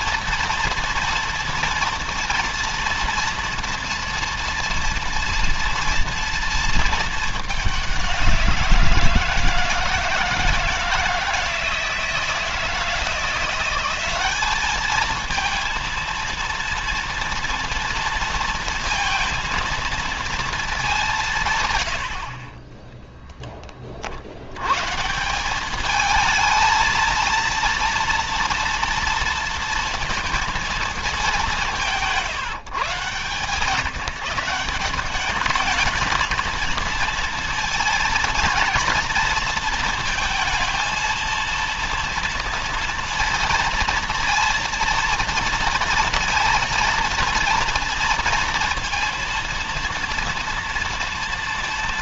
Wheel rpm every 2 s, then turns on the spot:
240, 230, 230, 220, 170, 160, 170, 220, 230, 220, 210, 20, 150, 220, 230, 220, 130, 180, 230, 230, 220, 230, 230, 230, 230, 230.
22-24